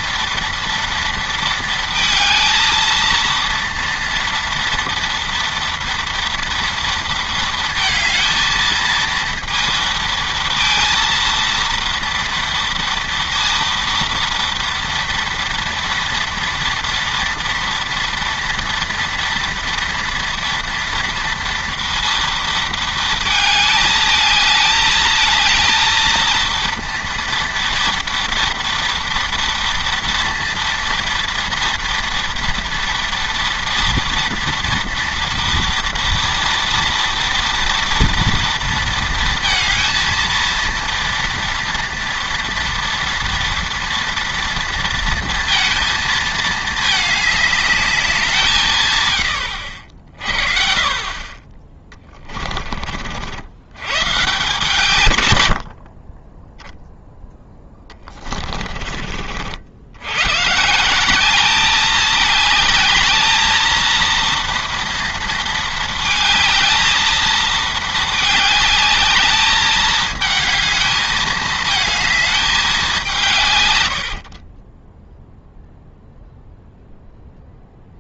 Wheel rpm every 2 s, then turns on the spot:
230, 230, 230, 230, 230, 230, 230, 230, 230, 230, 230, 230, 220, 230, 230, 230, 230, 230, 230, 230, 230, 230, 230, 220, 150, 40, 40, 160, 10, 40, 150, 220, 230, 220, 210, 220, 200, 20, 0.
58-60 74-76